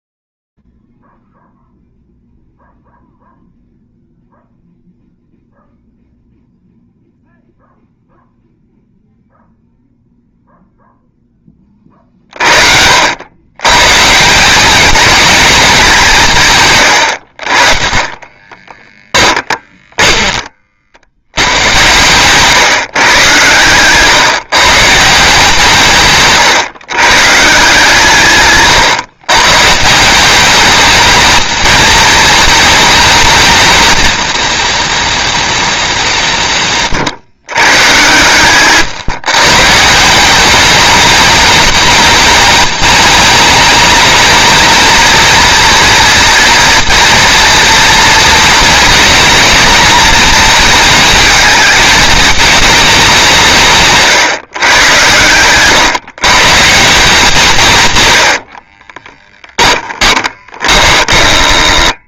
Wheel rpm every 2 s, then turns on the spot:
0, 0, 0, 0, 0, 0, 30, 130, 200, 30, 10, 120, 130, 150, 150, 160, 220, 220, 200, 120, 170, 210, 210, 240, 240, 240, 210, 140, 140, 110, 20.
18-22 54-56 58-62